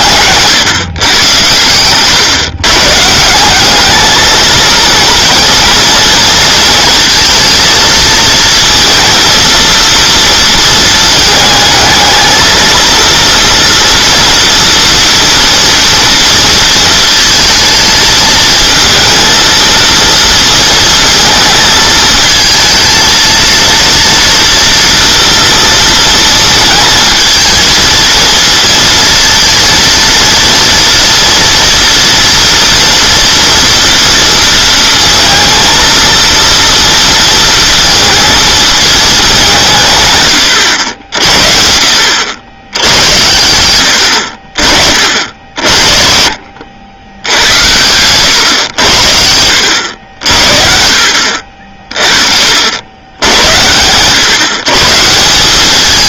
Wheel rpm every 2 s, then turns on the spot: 140, 140, 220, 230, 230, 220, 230, 230, 230, 220, 230, 230, 230, 220, 230, 230, 230, 230, 230, 220, 90, 100, 50, 90, 100, 50, 80, 140.
none